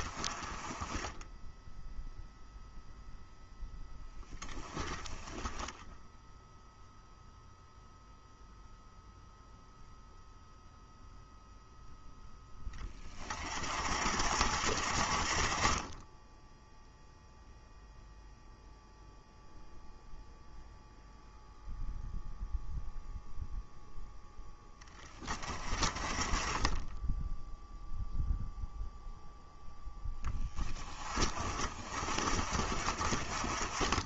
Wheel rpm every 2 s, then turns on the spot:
20, 0, 10, 0, 0, 0, 20, 50, 0, 0, 0, 0, 10, 10, 0, 20, 40.
none